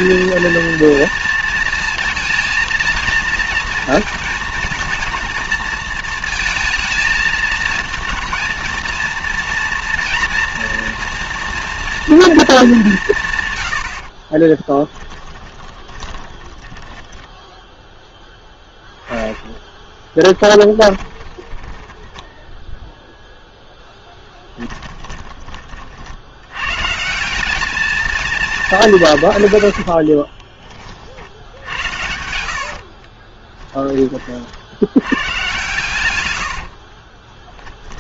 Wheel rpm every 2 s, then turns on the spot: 230, 230, 230, 220, 230, 230, 220, 20, 10, 0, 20, 10, 20, 100, 210, 30, 70, 70, 90.
14-18 20-26 30-34 36-38